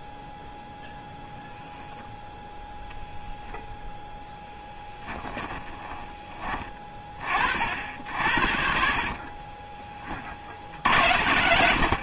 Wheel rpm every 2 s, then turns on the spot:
0, 0, 10, 20, 50, 50.
4-6